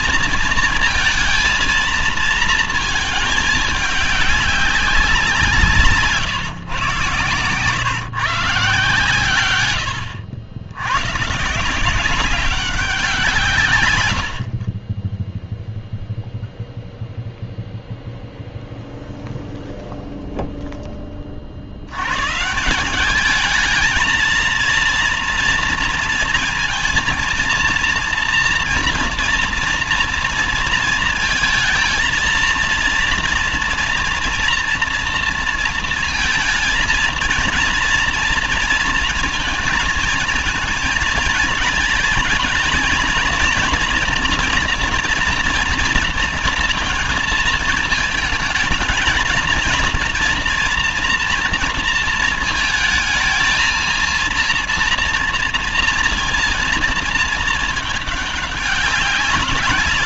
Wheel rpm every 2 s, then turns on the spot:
230, 230, 200, 130, 140, 110, 190, 40, 0, 0, 0, 150, 230, 230, 230, 230, 230, 230, 230, 230, 220, 220, 230, 230, 220, 240, 220, 230, 230, 200.
none